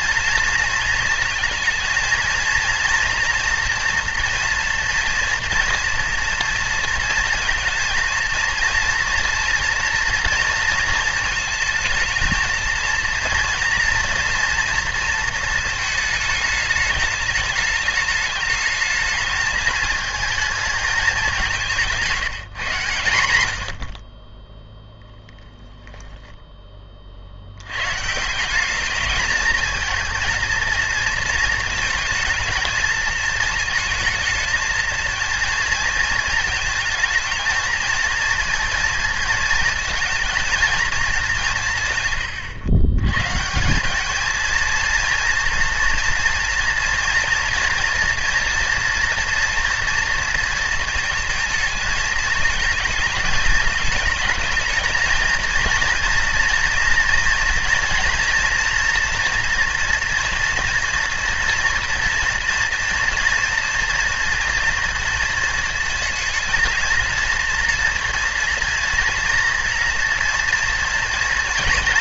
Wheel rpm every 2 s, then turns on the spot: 230, 230, 230, 230, 230, 230, 230, 230, 210, 210, 220, 150, 0, 20, 190, 220, 220, 220, 230, 230, 230, 110, 230, 230, 230, 230, 220, 210, 230, 240, 230, 230, 230, 230, 230, 240.
none